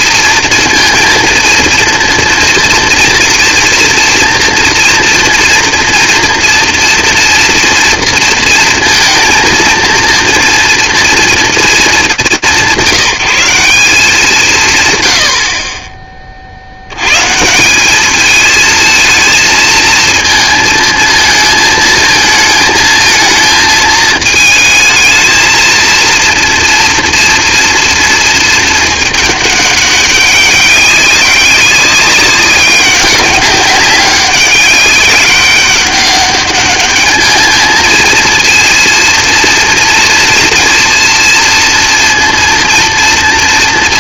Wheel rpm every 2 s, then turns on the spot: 230, 240, 230, 240, 230, 230, 180, 130, 80, 220, 220, 220, 220, 230, 220, 200, 200, 190, 200, 230, 230, 230.
none